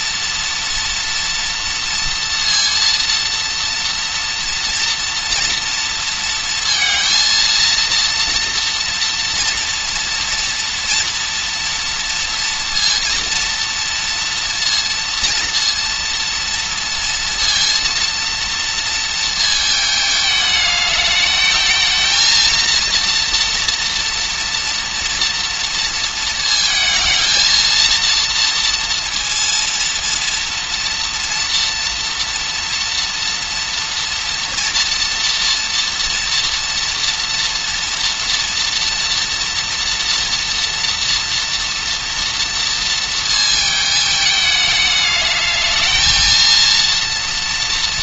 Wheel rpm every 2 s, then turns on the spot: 230, 230, 230, 230, 240, 230, 230, 230, 230, 230, 210, 230, 240, 220, 230, 230, 240, 230, 230, 230, 230, 230, 210, 230.
none